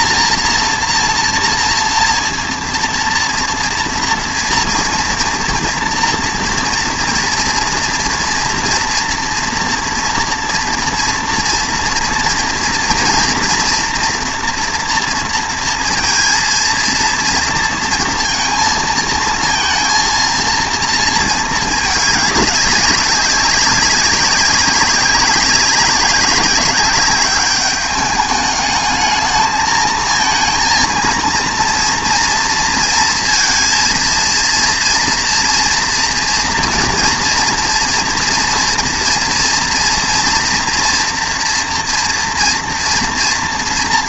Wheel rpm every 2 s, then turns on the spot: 230, 230, 230, 230, 230, 230, 230, 230, 230, 230, 230, 200, 190, 190, 210, 230, 230, 230, 230, 240, 230, 230.
none